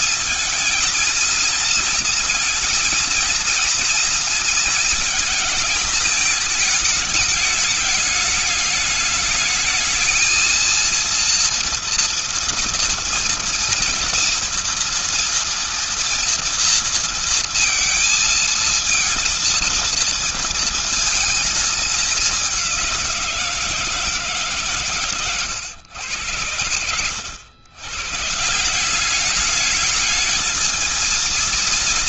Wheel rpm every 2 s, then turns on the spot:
230, 230, 220, 220, 210, 230, 230, 230, 230, 220, 230, 190, 140, 100, 180, 220.
none